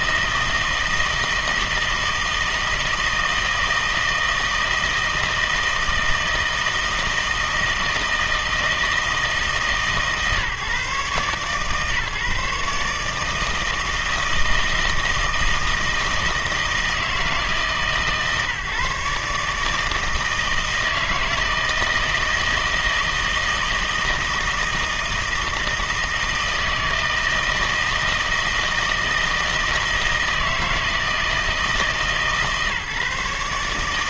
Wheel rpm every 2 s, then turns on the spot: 160, 160, 160, 160, 160, 140, 140, 160, 160, 150, 160, 160, 160, 160, 160, 160, 150.
none